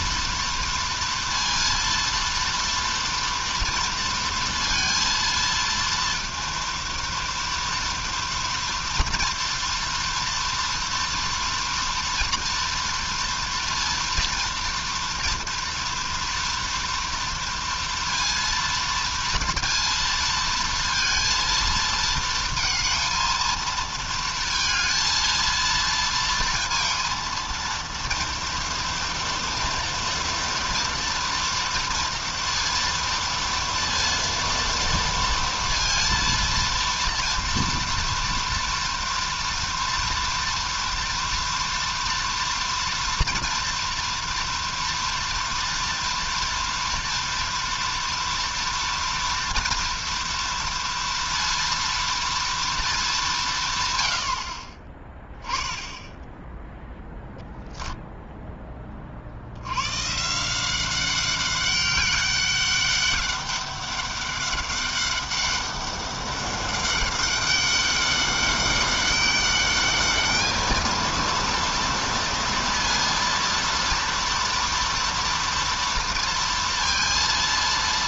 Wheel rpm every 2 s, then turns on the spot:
230, 230, 230, 230, 230, 230, 230, 230, 230, 230, 220, 220, 230, 230, 230, 230, 230, 230, 230, 230, 240, 230, 230, 230, 230, 230, 160, 10, 0, 70, 200, 200, 200, 200, 200, 230, 230, 230, 230.
none